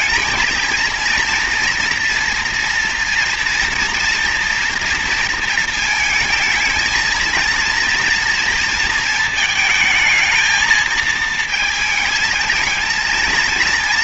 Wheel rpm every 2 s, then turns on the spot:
220, 240, 230, 220, 230, 220, 220.
none